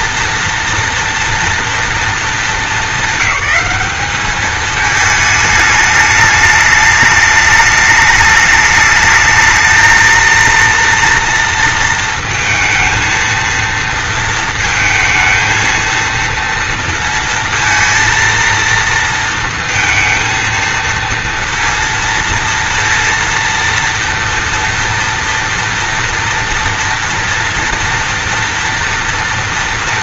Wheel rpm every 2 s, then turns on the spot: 230, 220, 210, 210, 210, 230, 230, 220, 230, 230, 230, 230, 230, 240, 230.
none